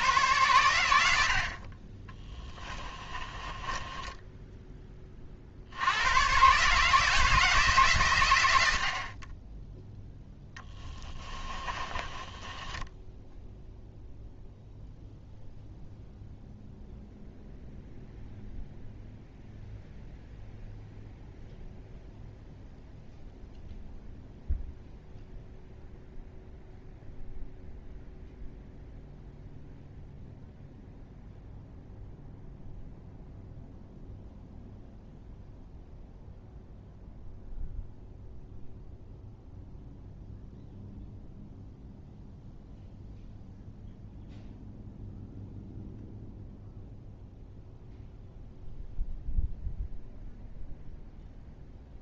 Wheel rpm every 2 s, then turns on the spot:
90, 20, 20, 150, 60, 20, 10, 0, 0, 0, 0, 0, 0, 0, 0, 0, 0, 0, 0, 0, 0, 0, 0, 0, 0, 0.
2-4 10-14